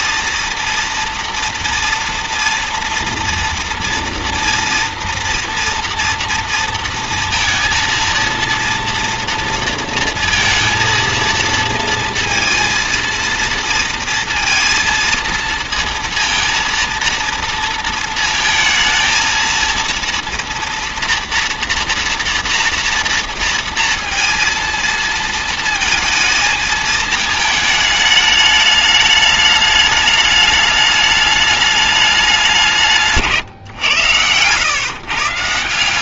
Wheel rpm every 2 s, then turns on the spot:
230, 230, 240, 230, 230, 230, 230, 230, 230, 230, 230, 230, 230, 220, 210, 210, 180, 120.
none